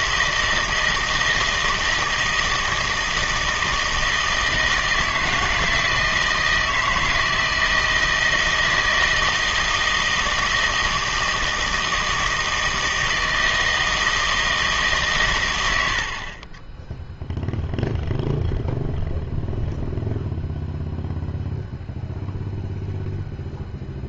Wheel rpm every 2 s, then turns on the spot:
160, 160, 160, 160, 160, 160, 160, 150, 20, 0, 0, 0.
none